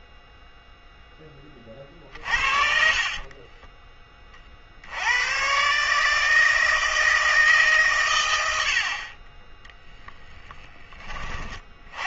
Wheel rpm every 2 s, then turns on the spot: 0, 60, 60, 160, 80, 20.
2-4